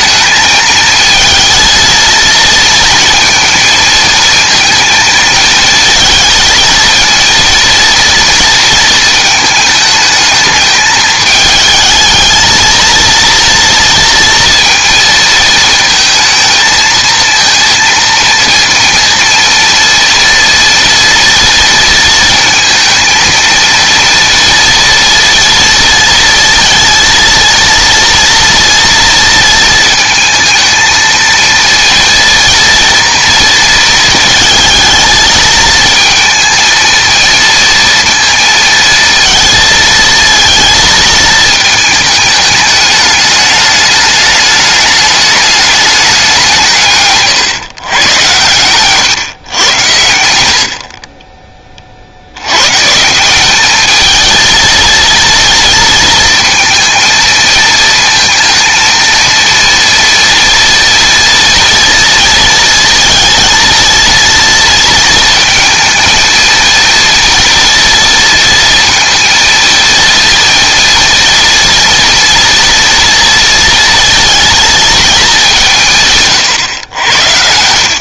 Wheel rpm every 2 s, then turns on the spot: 220, 230, 230, 230, 230, 220, 230, 230, 220, 230, 230, 230, 230, 230, 230, 220, 230, 220, 230, 230, 230, 210, 210, 150, 130, 40, 140, 230, 230, 230, 230, 230, 230, 230, 230, 230, 230, 230, 110.
none